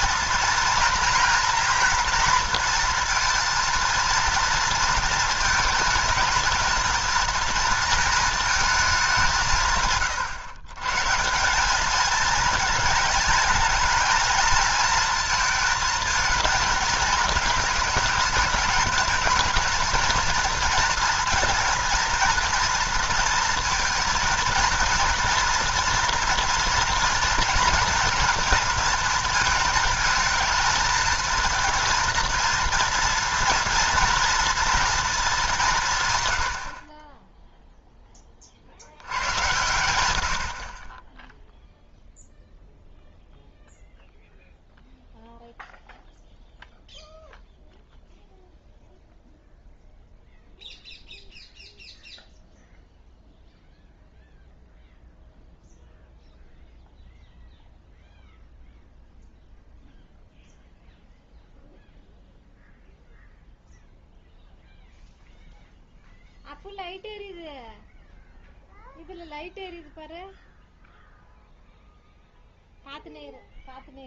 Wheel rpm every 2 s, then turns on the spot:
230, 230, 230, 230, 210, 140, 220, 230, 220, 220, 230, 230, 230, 230, 230, 220, 230, 230, 60, 70, 40, 0, 0, 0, 0, 0, 0, 0, 0, 0, 0, 0, 0, 0, 0, 0, 0.
none